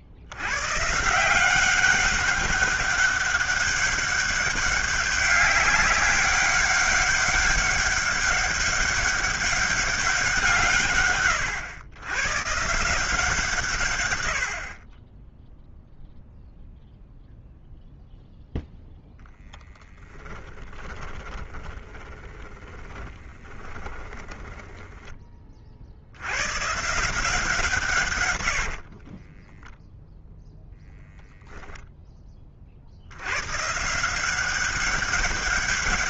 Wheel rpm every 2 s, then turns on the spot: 120, 200, 200, 200, 190, 160, 140, 50, 0, 0, 20, 20, 10, 140, 70, 0, 50, 190.
20-26 28-30